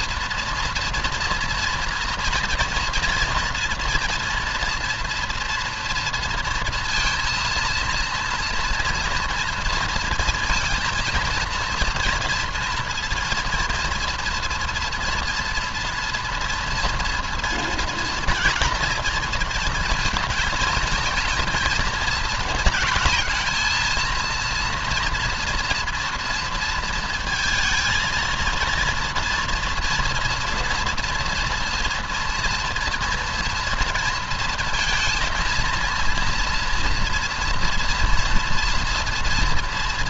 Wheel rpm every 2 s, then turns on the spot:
230, 230, 230, 230, 230, 230, 230, 230, 230, 230, 230, 220, 230, 230, 240, 240, 230, 230, 230, 230.
none